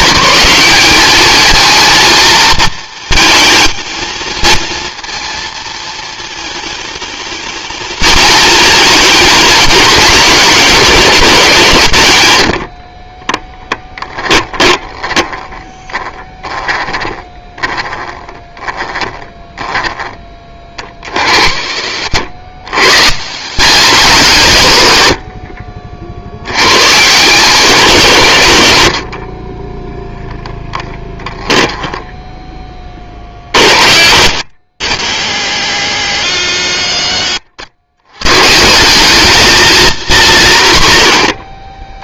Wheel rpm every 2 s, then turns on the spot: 200, 220, 230, 220, 220, 180, 40, 20, 10, 10, 40, 120, 110, 130, 80, 20, 30, 120, 120, 190, 130.
12-16 30-32